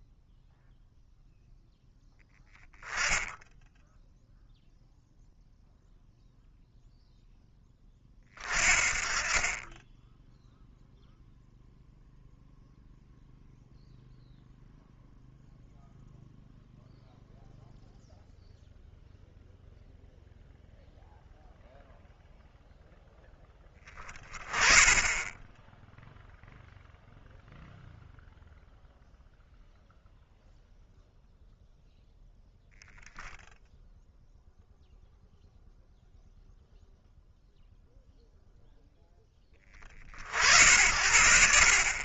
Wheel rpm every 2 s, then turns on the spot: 0, 10, 0, 0, 30, 0, 0, 0, 0, 0, 0, 0, 20, 0, 0, 0, 10, 0, 0, 0, 60.
none